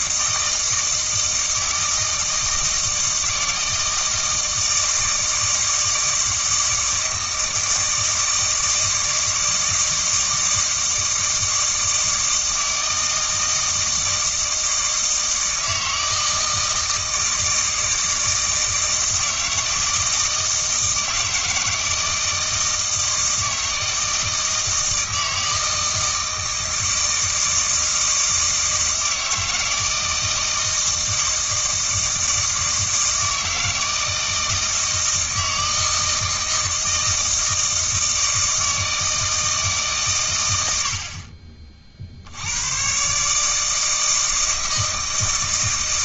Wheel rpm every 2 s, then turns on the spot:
160, 160, 160, 160, 160, 160, 160, 160, 160, 160, 160, 160, 160, 160, 160, 160, 160, 160, 160, 160, 80, 110, 160.
none